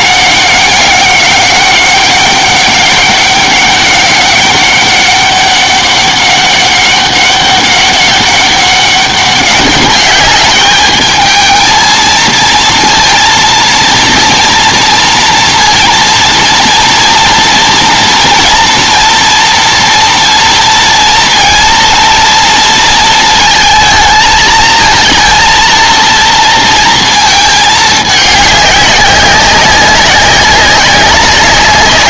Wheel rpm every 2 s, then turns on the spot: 190, 200, 200, 200, 200, 210, 230, 230, 230, 230, 230, 230, 220, 230, 200, 190.
none